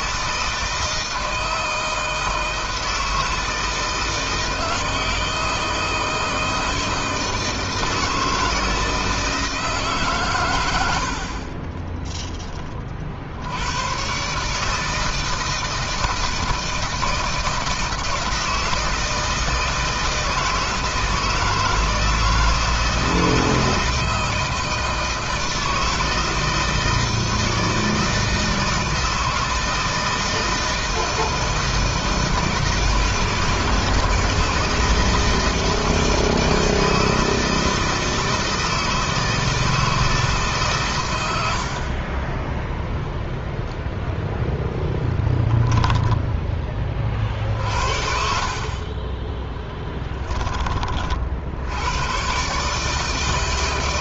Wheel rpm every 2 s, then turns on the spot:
160, 160, 160, 160, 160, 120, 30, 150, 160, 160, 160, 160, 160, 160, 160, 160, 160, 160, 160, 160, 140, 20, 0, 20, 50, 30, 140.
50-52